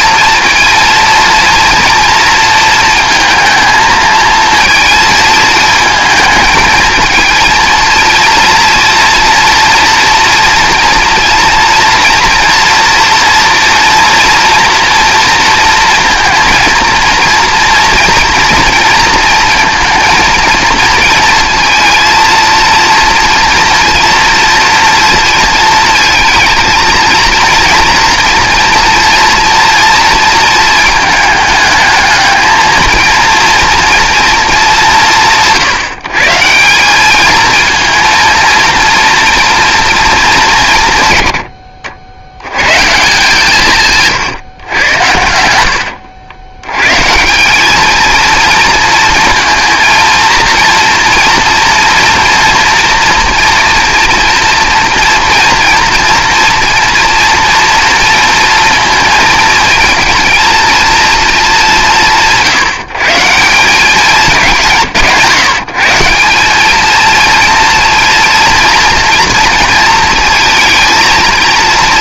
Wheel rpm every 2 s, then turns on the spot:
230, 230, 220, 220, 230, 240, 240, 230, 230, 230, 230, 230, 230, 220, 230, 220, 230, 210, 180, 230, 150, 120, 110, 110, 230, 240, 230, 230, 230, 230, 230, 160, 160, 210, 230, 230.
none